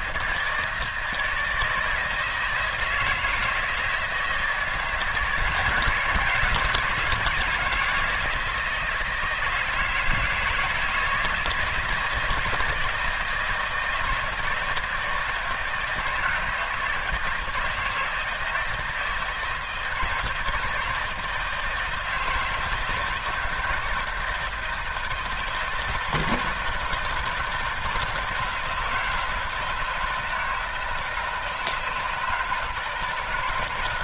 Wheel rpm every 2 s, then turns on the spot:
160, 160, 160, 170, 160, 160, 160, 160, 160, 160, 160, 160, 160, 160, 160, 160, 160.
none